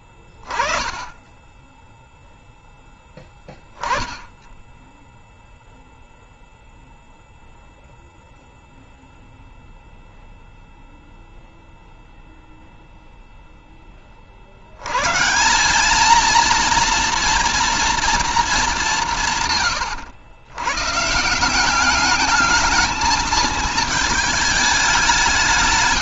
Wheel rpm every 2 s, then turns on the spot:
20, 0, 0, 0, 0, 0, 10, 170, 230, 150, 180, 220, 170.
none